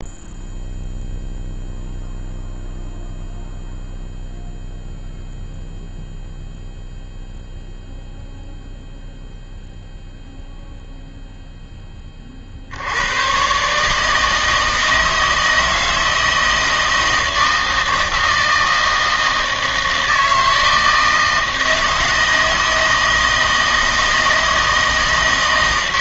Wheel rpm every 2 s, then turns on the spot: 0, 0, 0, 0, 0, 0, 80, 160, 160, 160, 160, 160, 160.
none